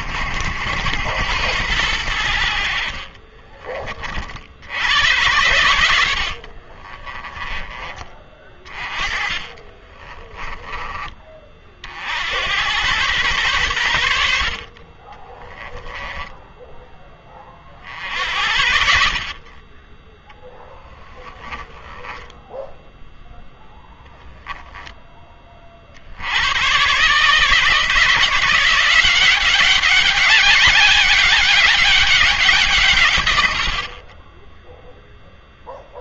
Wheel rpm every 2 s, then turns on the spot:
80, 50, 80, 40, 30, 10, 100, 40, 10, 60, 10, 0, 10, 120, 180, 200, 160, 0.
6-10 14-16